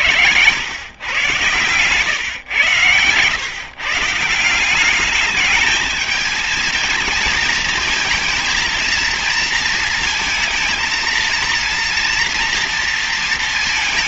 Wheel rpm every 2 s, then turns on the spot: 100, 120, 170, 220, 230, 230, 240.
none